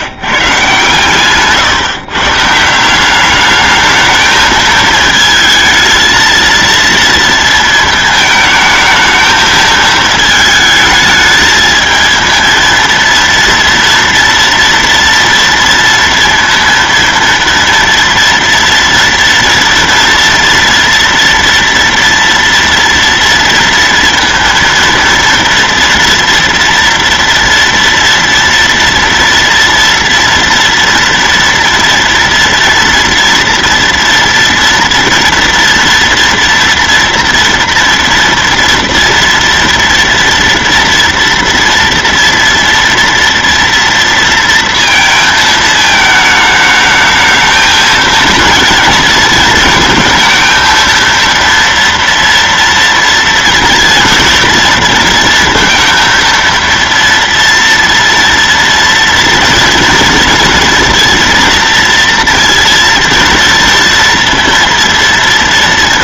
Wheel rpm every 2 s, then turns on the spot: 130, 160, 220, 230, 220, 220, 230, 230, 230, 230, 230, 230, 230, 230, 230, 230, 230, 230, 240, 230, 230, 230, 230, 210, 230, 230, 230, 230, 230, 230, 240, 230, 230.
none